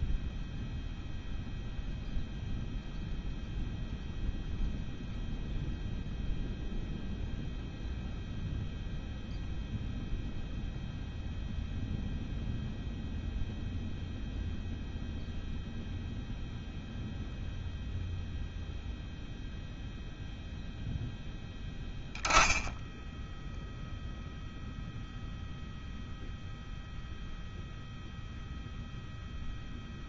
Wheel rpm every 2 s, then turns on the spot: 0, 0, 0, 0, 0, 0, 0, 0, 0, 0, 0, 10, 0, 0, 0.
none